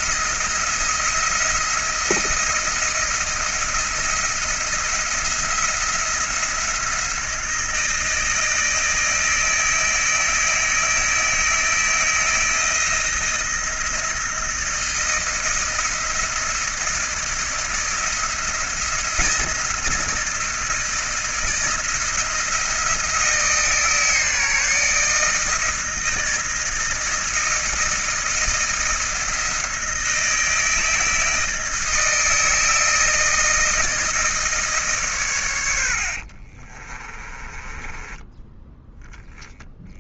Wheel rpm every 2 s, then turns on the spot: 170, 160, 160, 170, 160, 160, 170, 160, 160, 170, 160, 160, 150, 160, 160, 160, 160, 150, 30, 20.
36-38